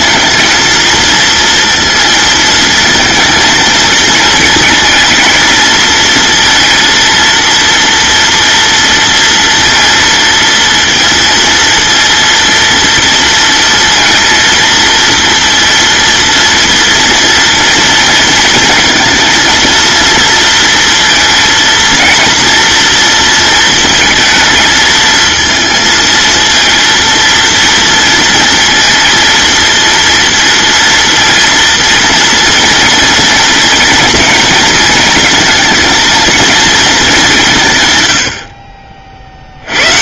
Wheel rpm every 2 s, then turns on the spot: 230, 220, 230, 230, 230, 230, 230, 230, 230, 230, 230, 230, 230, 230, 230, 230, 230, 230, 210, 40.
none